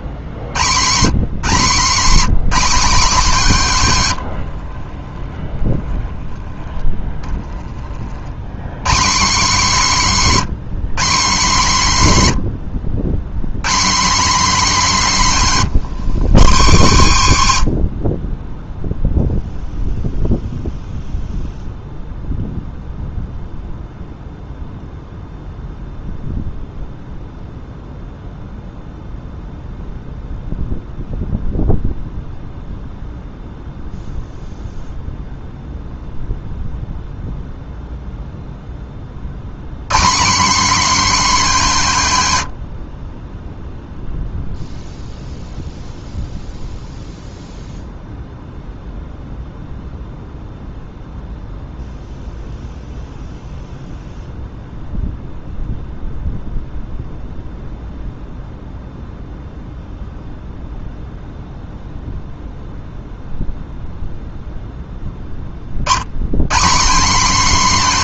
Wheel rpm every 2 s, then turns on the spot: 170, 230, 30, 10, 160, 200, 90, 230, 150, 0, 0, 0, 0, 0, 0, 0, 0, 0, 0, 20, 260, 70, 0, 0, 0, 0, 0, 0, 0, 0, 0, 0, 10, 200.
4-6